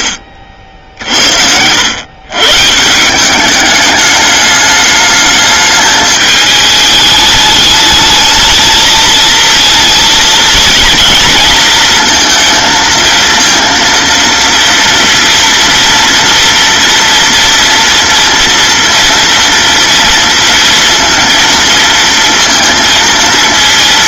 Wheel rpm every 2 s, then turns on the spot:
60, 150, 210, 210, 220, 230, 230, 230, 230, 230, 230, 230.
none